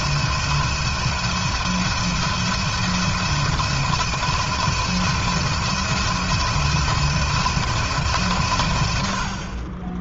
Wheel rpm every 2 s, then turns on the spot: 170, 170, 170, 170, 120.
none